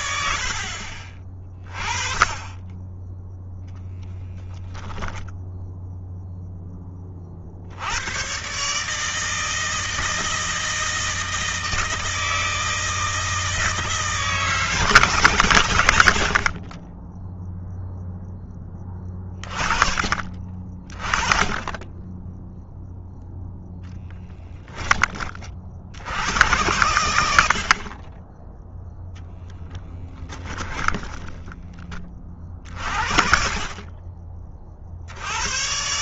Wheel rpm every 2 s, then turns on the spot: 40, 10, 0, 10, 140, 160, 160, 180, 50, 10, 30, 0, 10, 110, 10, 10, 50, 30.
30-32